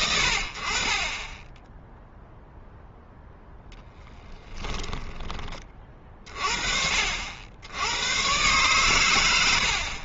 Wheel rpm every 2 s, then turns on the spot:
60, 0, 10, 50, 110.
4-6